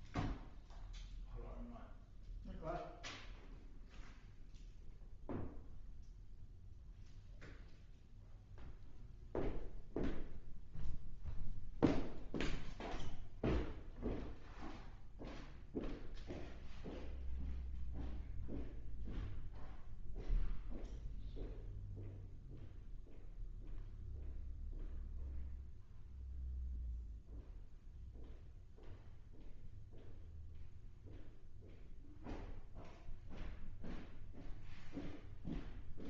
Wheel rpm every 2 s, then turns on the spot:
0, 0, 0, 0, 0, 0, 0, 0, 0, 0, 0, 0, 0, 0, 0, 0, 0, 0.
none